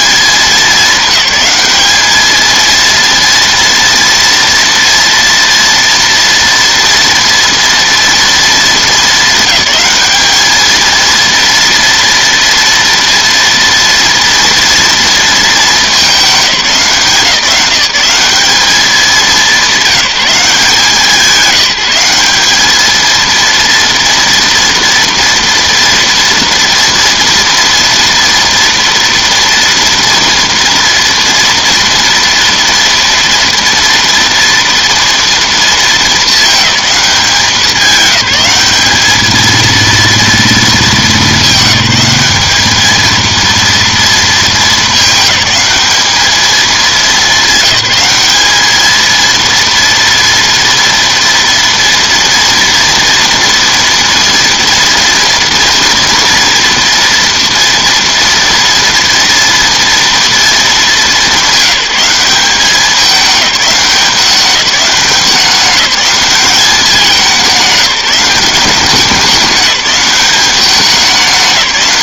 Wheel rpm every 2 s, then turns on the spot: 210, 230, 230, 230, 220, 220, 230, 230, 190, 210, 180, 210, 230, 240, 230, 230, 230, 230, 210, 210, 220, 210, 210, 220, 220, 230, 230, 230, 230, 230, 220, 200, 190, 200, 180, 200.
none